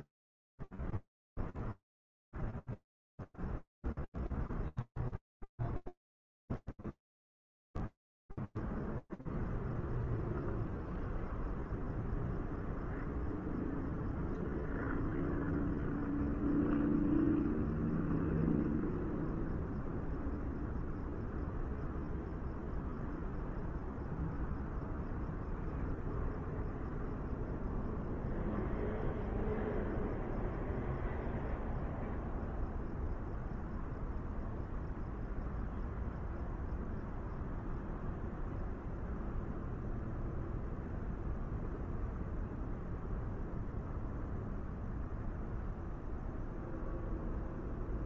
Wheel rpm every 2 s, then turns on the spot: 0, 0, 0, 0, 0, 0, 0, 0, 0, 0, 0, 0, 0, 0, 0, 0, 0, 0, 0, 0, 0, 0, 0, 0.
none